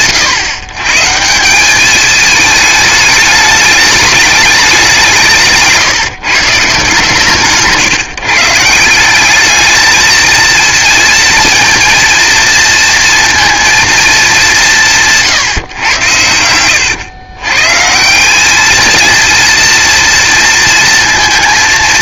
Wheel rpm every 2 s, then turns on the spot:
130, 220, 180, 140, 170, 230, 230, 170, 100, 220, 230.
none